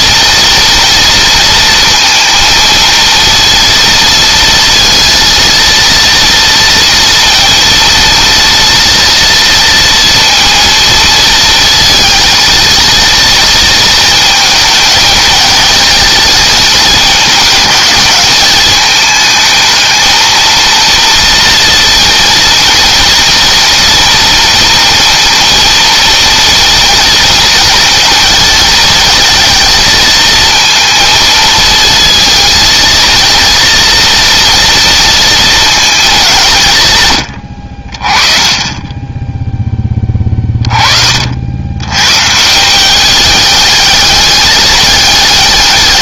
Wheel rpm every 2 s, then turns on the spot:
230, 230, 230, 230, 230, 230, 230, 220, 220, 210, 230, 230, 230, 230, 230, 230, 230, 230, 180, 20, 30, 180, 210.
none